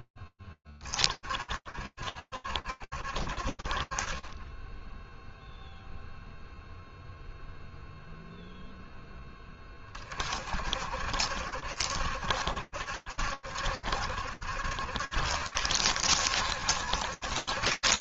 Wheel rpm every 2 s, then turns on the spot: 20, 60, 10, 0, 20, 70, 70, 70, 70.
none